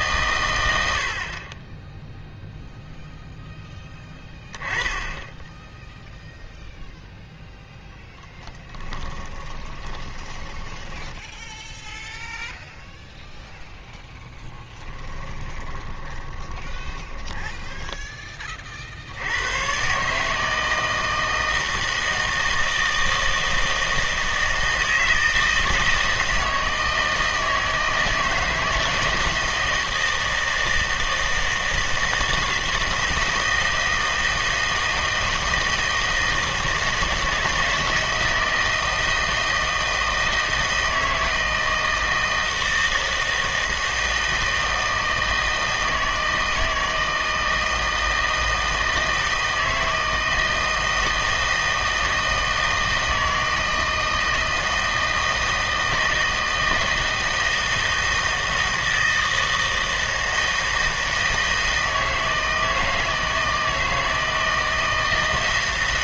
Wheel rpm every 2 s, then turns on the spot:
100, 0, 10, 0, 10, 10, 0, 10, 20, 40, 160, 160, 160, 160, 160, 160, 160, 160, 160, 160, 160, 160, 160, 160, 160, 160, 160, 160, 160, 160, 160, 160, 160.
8-12 14-18